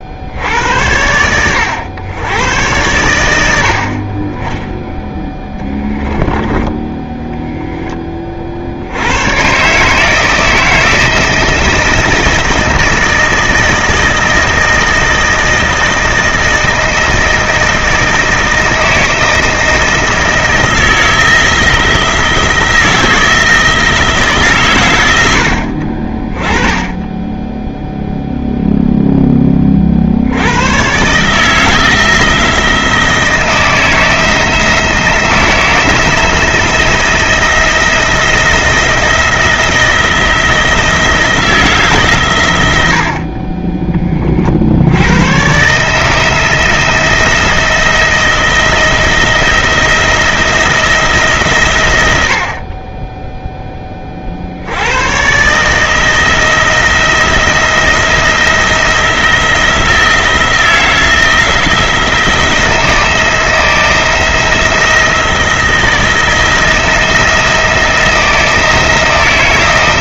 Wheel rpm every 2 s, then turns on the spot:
90, 100, 0, 10, 80, 160, 170, 160, 160, 160, 170, 170, 120, 10, 0, 120, 170, 160, 170, 170, 170, 80, 70, 170, 170, 160, 30, 90, 160, 160, 170, 170, 170, 170, 170.
none